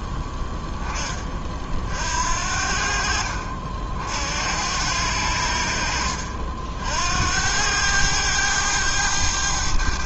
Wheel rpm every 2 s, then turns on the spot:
10, 60, 80, 60, 100.
none